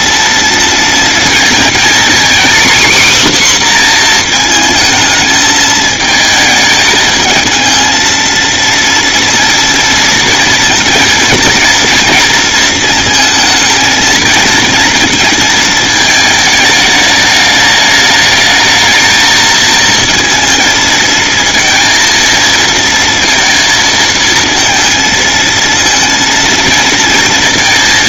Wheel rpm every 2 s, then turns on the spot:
230, 270, 220, 220, 230, 230, 230, 230, 210, 220, 230, 230, 220, 230.
none